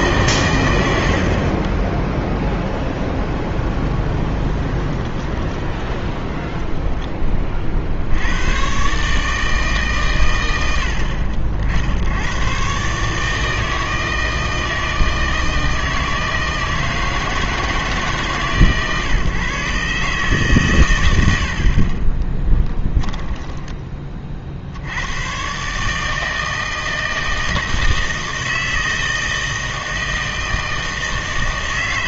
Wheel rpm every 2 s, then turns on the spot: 100, 20, 20, 20, 130, 70, 140, 160, 160, 140, 120, 10, 80, 160, 160, 160.
2-8 22-24